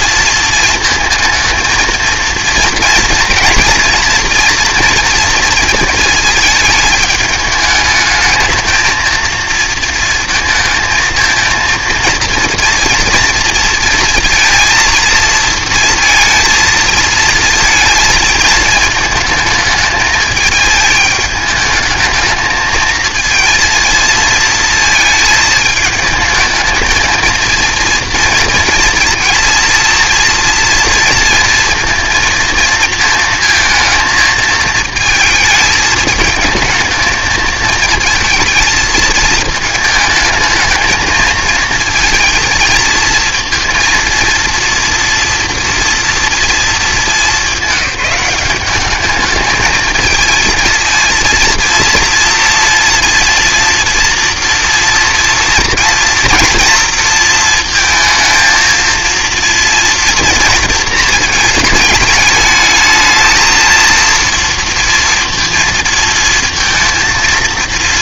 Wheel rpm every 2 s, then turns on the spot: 230, 230, 230, 220, 220, 220, 230, 230, 230, 220, 220, 220, 230, 220, 230, 230, 230, 220, 220, 220, 220, 220, 230, 230, 200, 230, 230, 230, 230, 230, 230, 210, 230, 230.
none